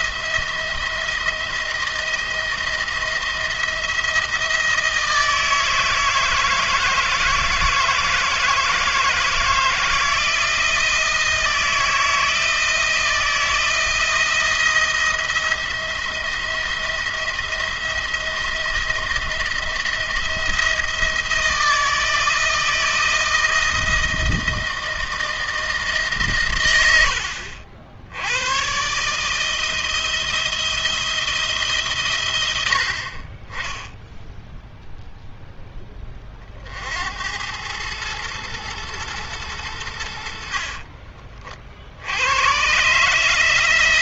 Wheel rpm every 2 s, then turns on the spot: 170, 170, 170, 160, 160, 170, 160, 170, 170, 170, 170, 160, 160, 110, 110, 170, 90, 0, 50, 110, 60, 120.
40-42